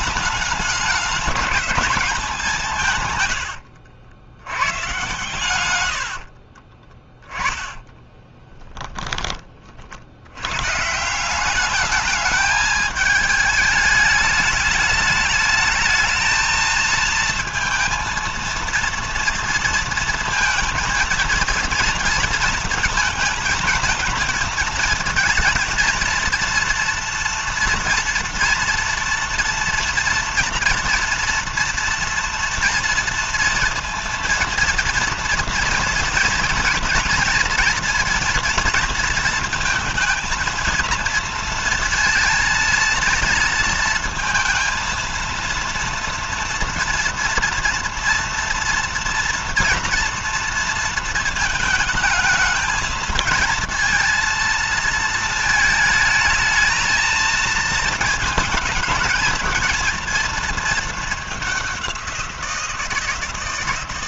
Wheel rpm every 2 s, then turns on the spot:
210, 140, 110, 20, 30, 150, 210, 210, 230, 230, 230, 220, 220, 230, 240, 230, 240, 230, 230, 230, 230, 230, 230, 230, 230, 230, 220, 230, 220, 220, 210, 170.
6-8